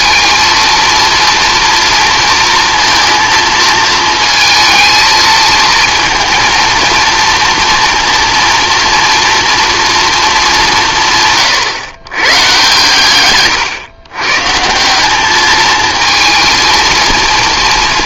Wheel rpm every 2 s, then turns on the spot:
230, 230, 220, 230, 240, 160, 120, 170, 230.
none